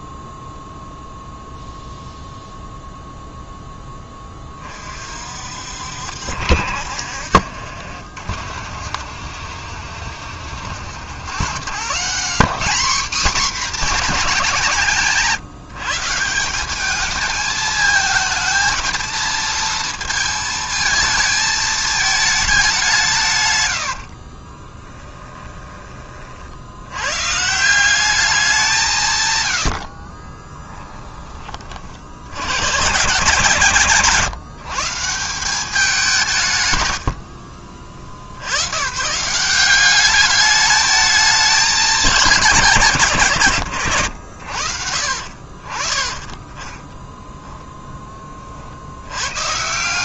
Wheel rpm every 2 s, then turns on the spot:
0, 0, 40, 60, 50, 60, 220, 180, 200, 220, 220, 180, 20, 80, 170, 10, 130, 160, 110, 110, 210, 180, 50, 10, 70.
24-26 30-32